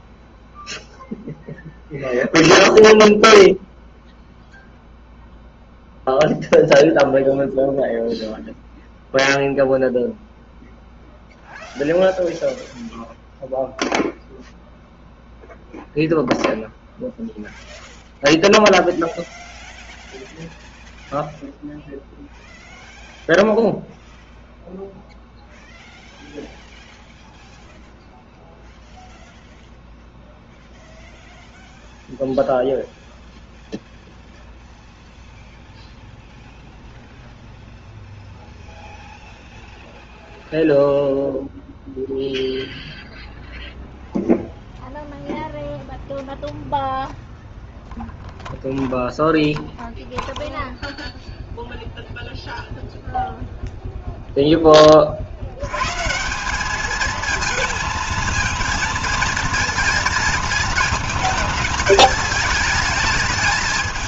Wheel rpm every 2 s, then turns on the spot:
10, 0, 0, 0, 0, 0, 0, 0, 0, 0, 0, 0, 0, 0, 0, 0, 0, 0, 0, 0, 0, 0, 0, 0, 0, 0, 0, 30, 210, 230, 220, 220.
none